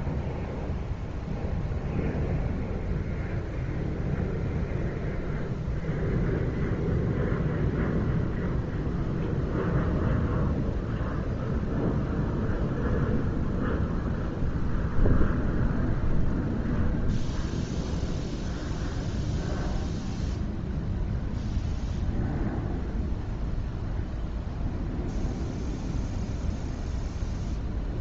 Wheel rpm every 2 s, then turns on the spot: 0, 0, 0, 0, 0, 0, 0, 0, 0, 0, 0, 0, 0, 0.
none